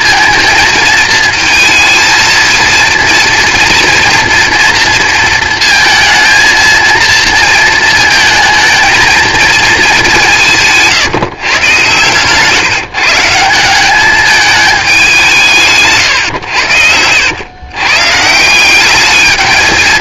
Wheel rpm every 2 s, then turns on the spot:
230, 230, 230, 230, 230, 160, 150, 210, 80, 190.
16-18